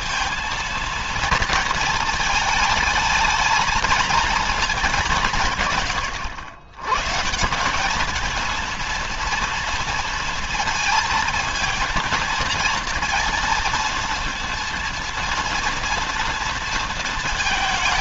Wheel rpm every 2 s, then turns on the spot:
230, 220, 200, 130, 230, 230, 230, 230, 230.
none